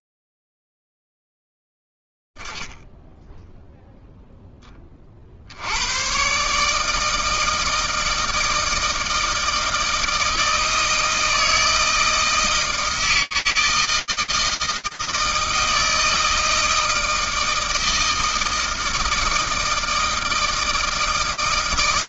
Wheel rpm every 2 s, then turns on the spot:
10, 20, 0, 90, 160, 160, 160, 160, 160, 160, 160.
none